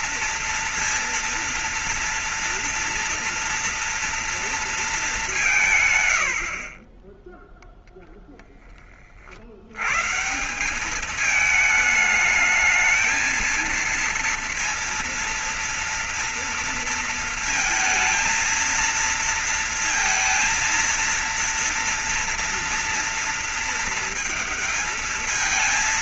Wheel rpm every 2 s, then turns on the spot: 230, 240, 230, 90, 0, 150, 210, 230, 230, 230, 230, 230, 220.
none